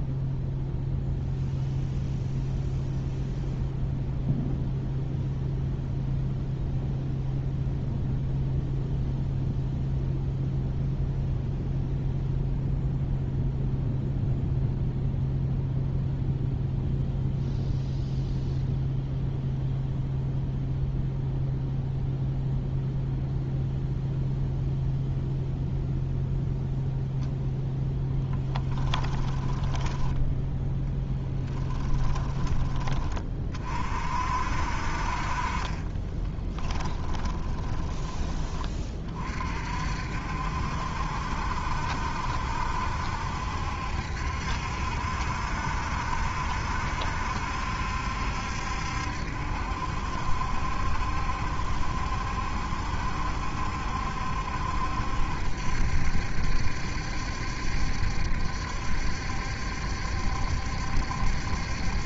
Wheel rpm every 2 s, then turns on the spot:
0, 0, 0, 0, 0, 0, 0, 0, 0, 0, 0, 0, 0, 0, 10, 10, 10, 50, 20, 20, 60, 70, 70, 70, 70, 70, 70, 70, 70, 70, 70.
36-38